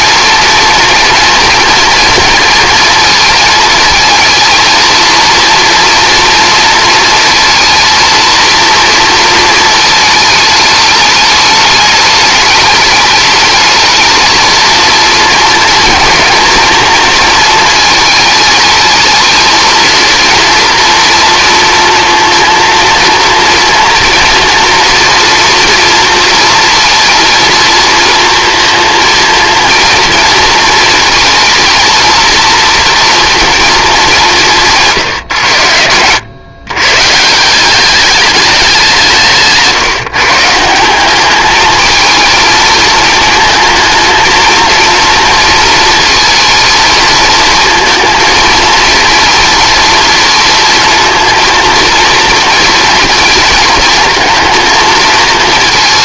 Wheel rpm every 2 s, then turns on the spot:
230, 230, 220, 230, 230, 210, 210, 230, 230, 220, 230, 230, 230, 230, 230, 230, 230, 160, 120, 190, 170, 230, 220, 220, 230, 230, 230, 220.
none